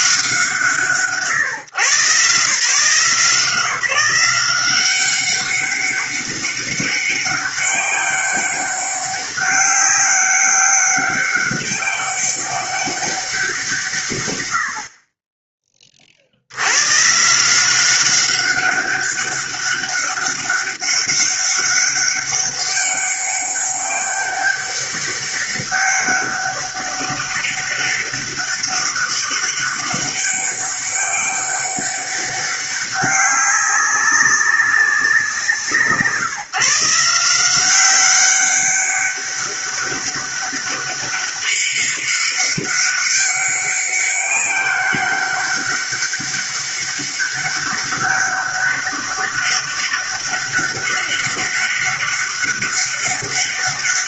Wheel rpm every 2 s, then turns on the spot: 140, 160, 190, 200, 200, 200, 200, 50, 120, 200, 200, 200, 200, 200, 200, 200, 200, 180, 160, 200, 200, 200, 200, 200, 200, 200, 200.
none